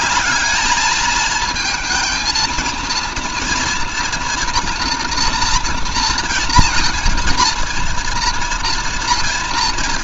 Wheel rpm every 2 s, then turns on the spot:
220, 230, 240, 230, 230.
none